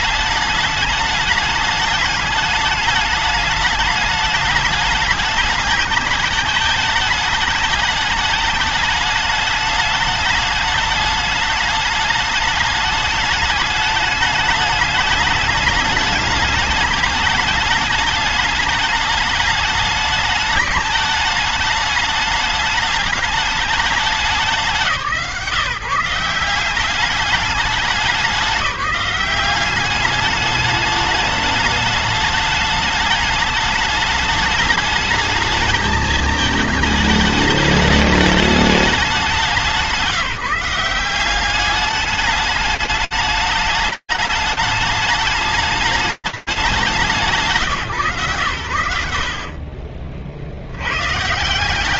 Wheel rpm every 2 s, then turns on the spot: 210, 210, 210, 210, 210, 210, 220, 210, 210, 210, 210, 210, 180, 180, 200, 210, 210, 210, 220, 200, 170, 210, 210, 190, 50, 150.
none